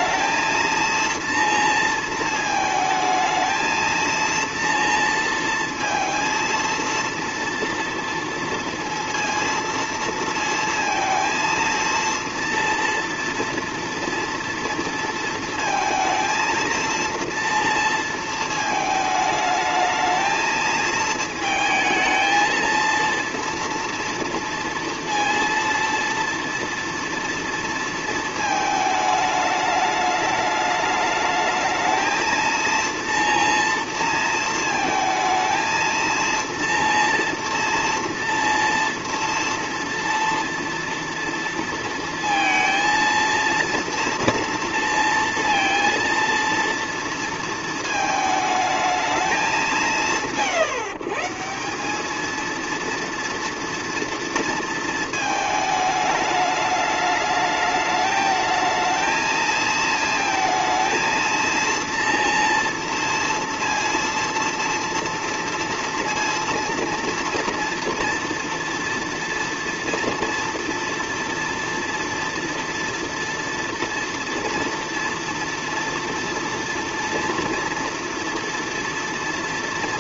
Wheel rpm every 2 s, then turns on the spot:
230, 220, 230, 230, 230, 230, 230, 230, 230, 220, 220, 230, 230, 230, 220, 210, 230, 230, 230, 230, 230, 230, 230, 230, 220, 110, 230, 230, 210, 220, 230, 230, 230, 230, 230, 230, 230, 230, 230, 230.
none